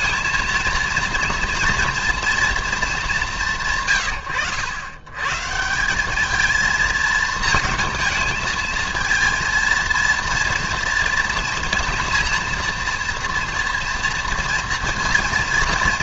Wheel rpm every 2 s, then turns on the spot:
230, 230, 110, 220, 220, 230, 230, 230.
none